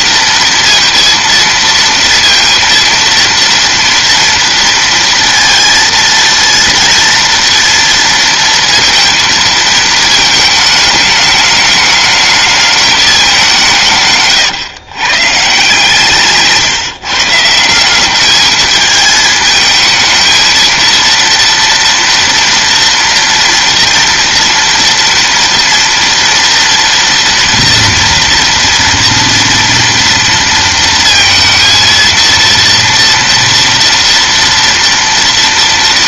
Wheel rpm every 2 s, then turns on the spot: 230, 230, 230, 230, 230, 220, 210, 130, 140, 210, 230, 230, 230, 230, 230, 230, 230, 240.
none